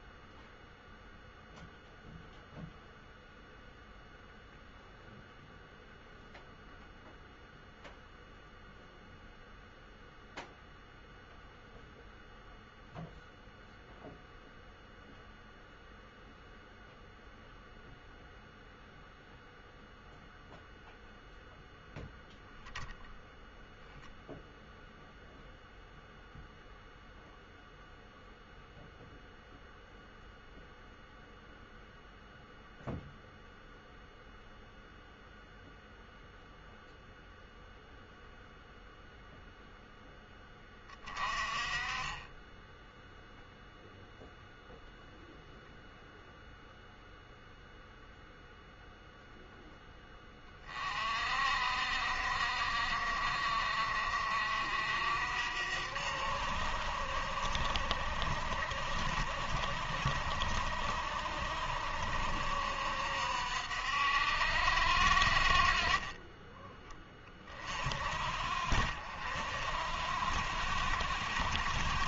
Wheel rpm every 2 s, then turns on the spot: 0, 0, 0, 0, 0, 0, 0, 0, 0, 0, 0, 20, 0, 0, 0, 0, 0, 0, 0, 0, 20, 0, 0, 0, 0, 30, 50, 60, 60, 50, 60, 60, 60, 10, 50, 70.
none